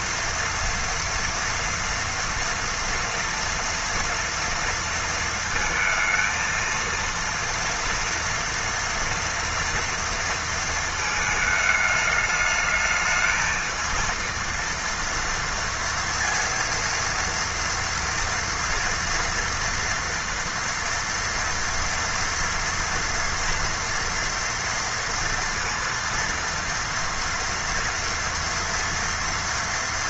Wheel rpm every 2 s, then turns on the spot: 230, 230, 230, 230, 230, 220, 220, 230, 230, 230, 230, 230, 230, 230, 230.
none